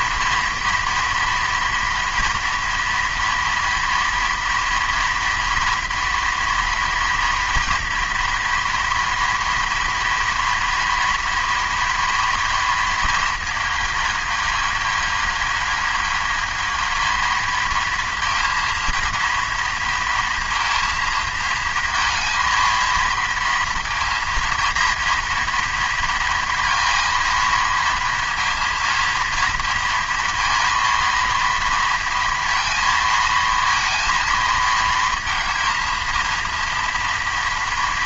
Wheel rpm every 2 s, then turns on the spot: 230, 230, 230, 230, 230, 230, 230, 220, 220, 230, 230, 230, 230, 230, 230, 230, 230, 220, 230.
none